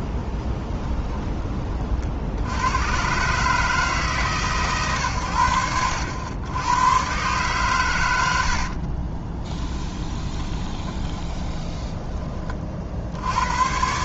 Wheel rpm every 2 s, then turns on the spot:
20, 110, 130, 110, 50, 20, 60.
0-2 8-12